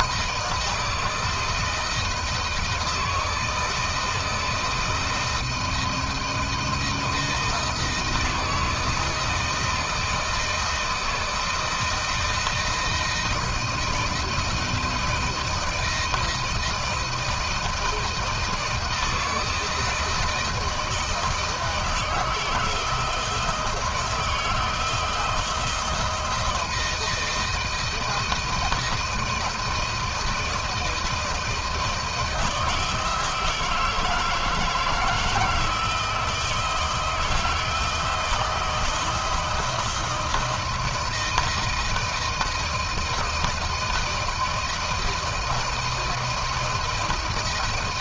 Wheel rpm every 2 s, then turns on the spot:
160, 160, 160, 160, 160, 160, 160, 170, 170, 160, 160, 160, 160, 170, 160, 160, 160, 160, 160, 160, 160, 170, 170, 160.
none